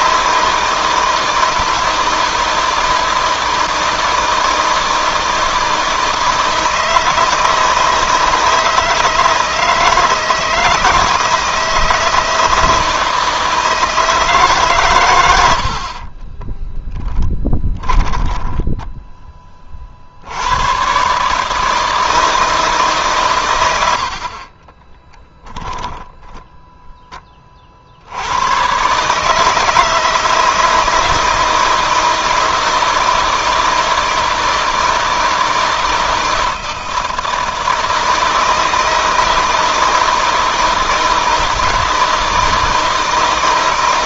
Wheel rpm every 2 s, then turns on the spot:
160, 160, 160, 160, 160, 150, 160, 120, 10, 20, 130, 150, 20, 10, 130, 160, 160, 160, 160, 160, 160, 160.
16-18 24-26